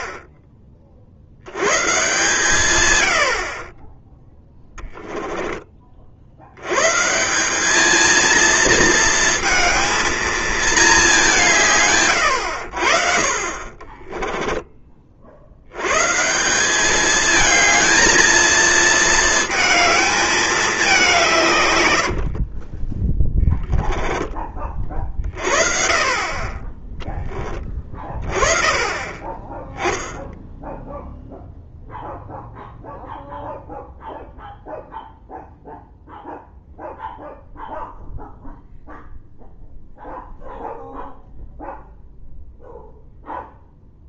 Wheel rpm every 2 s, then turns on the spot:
40, 110, 10, 90, 230, 220, 90, 10, 170, 230, 210, 50, 30, 30, 30, 10, 0, 0, 0, 0, 0, 0.
22-24